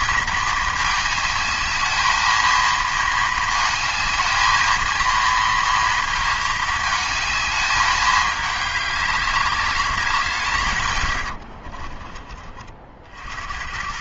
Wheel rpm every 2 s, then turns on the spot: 220, 230, 230, 220, 200, 130, 40.
none